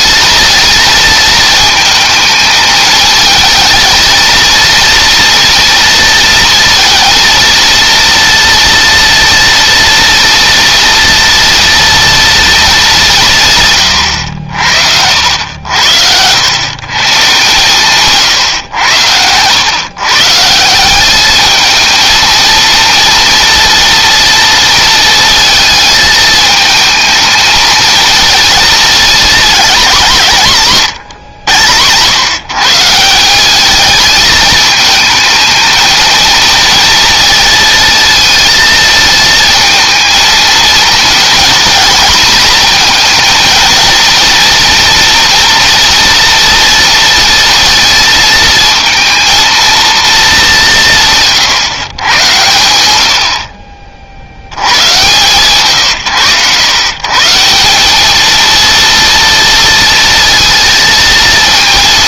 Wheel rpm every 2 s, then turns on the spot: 220, 220, 230, 230, 230, 230, 180, 70, 140, 100, 200, 230, 230, 220, 220, 120, 160, 220, 230, 220, 230, 230, 230, 230, 230, 150, 80, 130, 140, 230, 230.
none